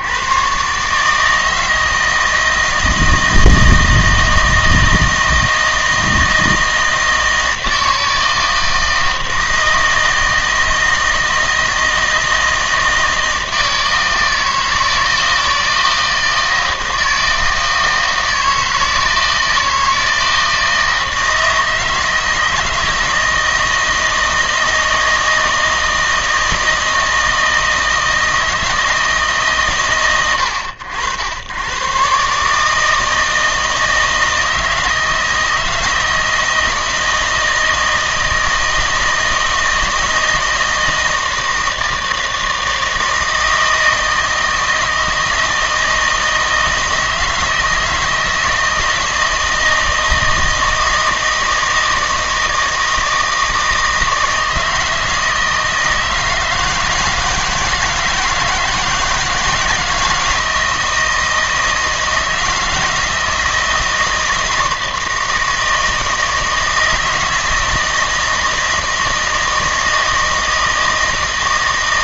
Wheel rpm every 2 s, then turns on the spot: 140, 160, 160, 160, 160, 160, 160, 160, 160, 160, 160, 160, 160, 160, 160, 80, 150, 160, 160, 160, 160, 160, 160, 160, 160, 160, 160, 160, 160, 160, 160, 160, 160, 160, 160, 160.
none